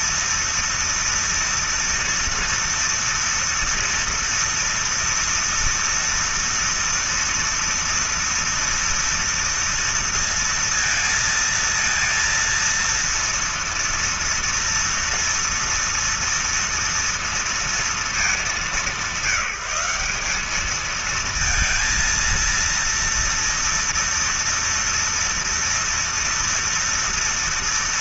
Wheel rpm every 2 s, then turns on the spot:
230, 230, 230, 230, 230, 230, 230, 230, 230, 200, 190, 230, 230, 230.
none